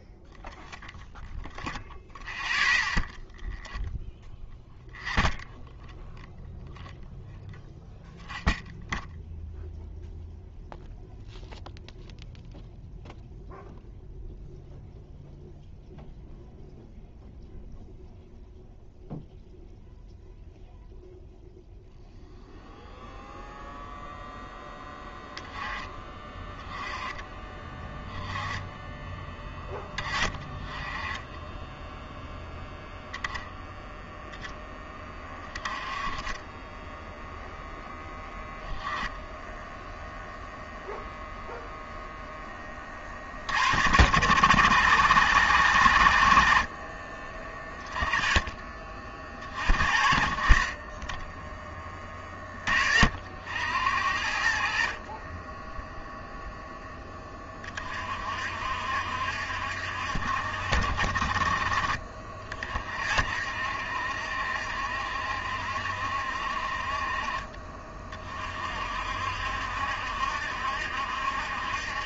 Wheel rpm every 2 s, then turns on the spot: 0, 0, 0, 0, 0, 0, 0, 0, 0, 0, 0, 0, 10, 20, 10, 20, 0, 10, 0, 0, 0, 30, 110, 30, 40, 20, 50, 50, 10, 60, 50, 60, 70, 40, 60, 70.
none